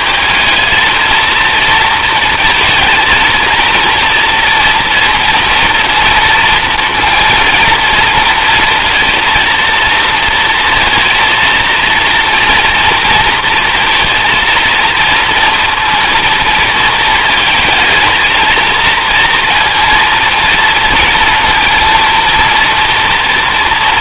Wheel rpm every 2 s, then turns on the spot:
220, 220, 230, 230, 230, 230, 230, 230, 220, 230, 230, 230.
none